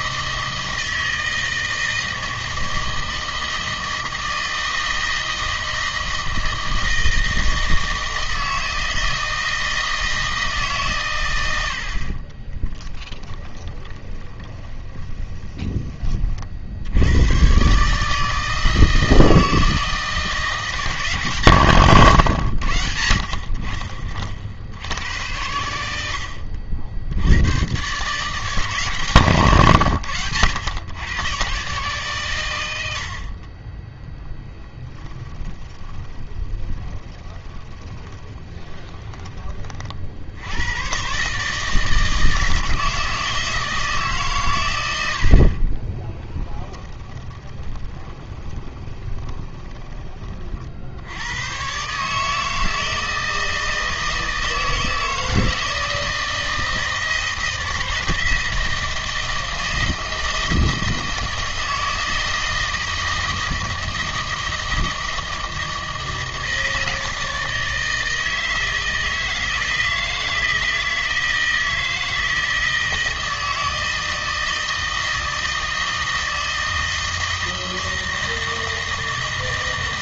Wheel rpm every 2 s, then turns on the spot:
160, 160, 160, 160, 160, 150, 20, 20, 60, 160, 170, 100, 70, 70, 150, 110, 110, 10, 20, 20, 90, 160, 110, 20, 20, 60, 160, 160, 160, 160, 160, 160, 160, 160, 160, 160, 160, 160, 160, 160.
12-16 34-40 46-50